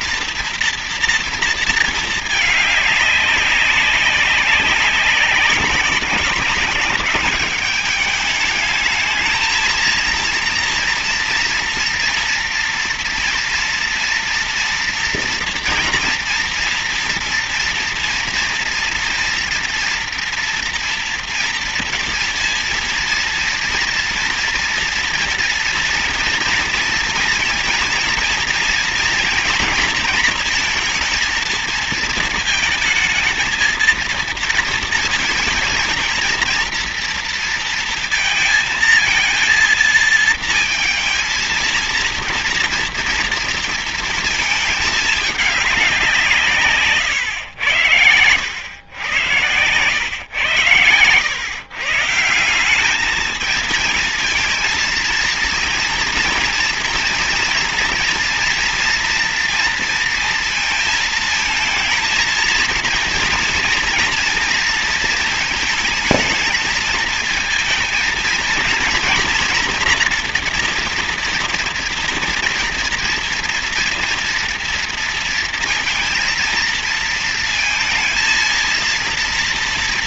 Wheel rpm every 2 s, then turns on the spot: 230, 210, 200, 200, 210, 230, 230, 230, 230, 230, 230, 230, 230, 230, 230, 230, 220, 230, 230, 230, 230, 230, 220, 140, 100, 110, 180, 220, 230, 230, 230, 230, 230, 220, 230, 230, 230, 230, 230, 230.
46-48